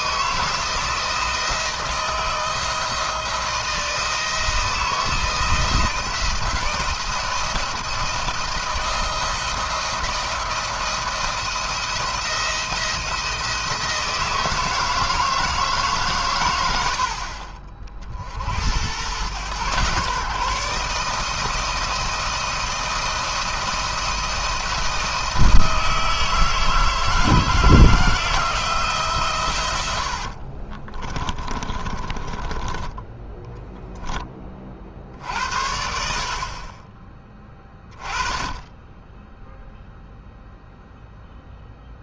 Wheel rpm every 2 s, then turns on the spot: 160, 160, 160, 170, 170, 170, 170, 160, 100, 100, 150, 170, 170, 160, 160, 50, 20, 30, 40, 20, 0.
30-34